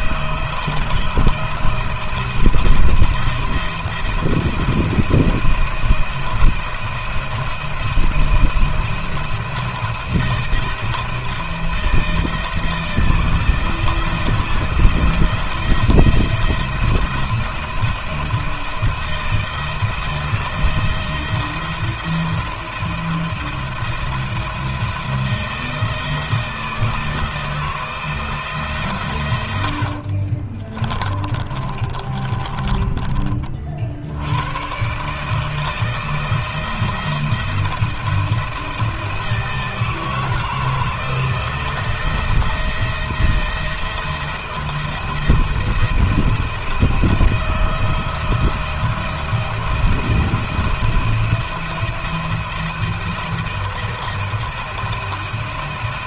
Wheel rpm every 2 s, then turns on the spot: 170, 170, 170, 170, 170, 170, 160, 170, 170, 170, 170, 170, 170, 160, 150, 40, 30, 100, 160, 170, 160, 170, 170, 160, 170, 170, 170, 170.
30-34